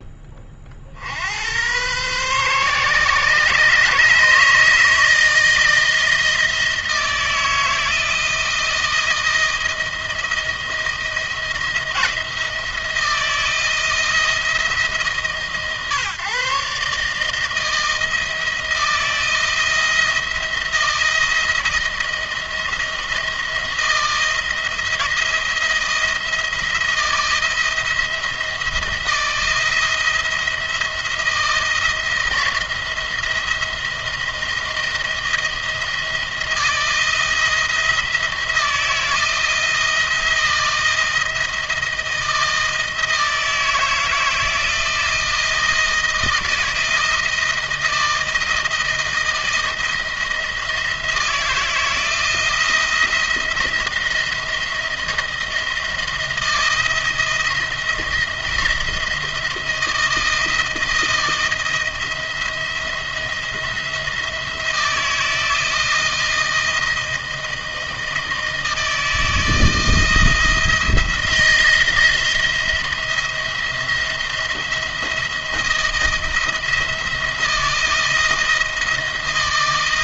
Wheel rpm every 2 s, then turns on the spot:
60, 130, 160, 160, 160, 170, 160, 150, 140, 170, 170, 160, 170, 170, 170, 170, 170, 160, 170, 170, 160, 160, 160, 160, 160, 160, 170, 170, 160, 170, 160, 170, 170, 160, 160, 160, 170, 170, 170, 160.
none